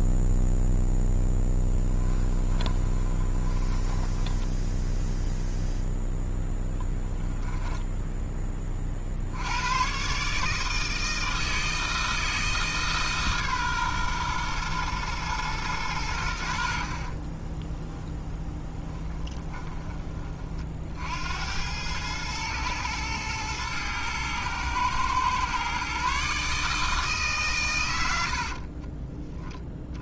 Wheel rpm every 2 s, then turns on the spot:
0, 20, 0, 10, 40, 160, 150, 120, 50, 10, 60, 110, 110, 150, 30.
2-4 6-8 16-20 28-30